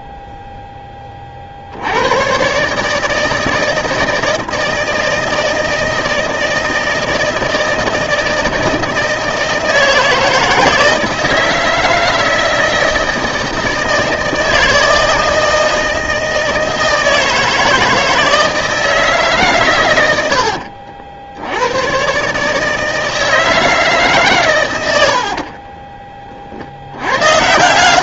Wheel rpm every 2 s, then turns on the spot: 10, 140, 160, 160, 160, 160, 160, 160, 160, 160, 70, 160, 110, 60.
20-22